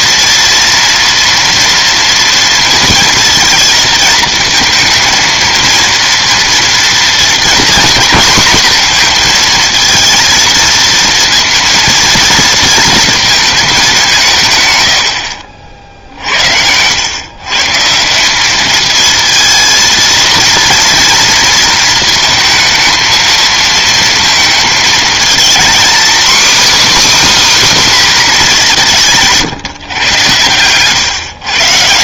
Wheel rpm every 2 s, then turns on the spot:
240, 230, 230, 240, 230, 230, 220, 60, 120, 230, 230, 220, 230, 300, 150, 130.
28-30